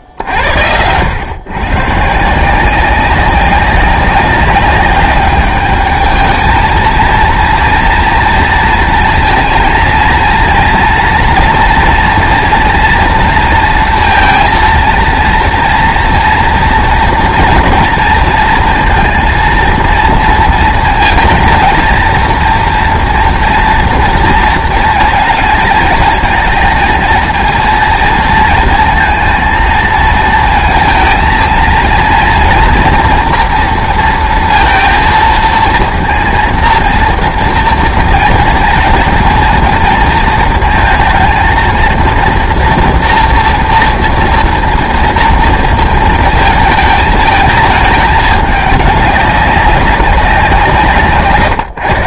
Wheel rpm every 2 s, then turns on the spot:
90, 180, 200, 220, 230, 230, 240, 230, 240, 230, 230, 230, 220, 220, 230, 230, 240, 230, 230, 230, 230, 230, 230, 220, 200, 180.
none